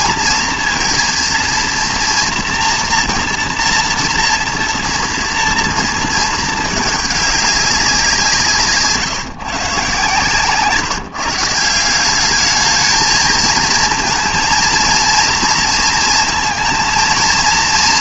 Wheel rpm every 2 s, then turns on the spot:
230, 240, 230, 210, 150, 150, 210, 230, 230.
10-12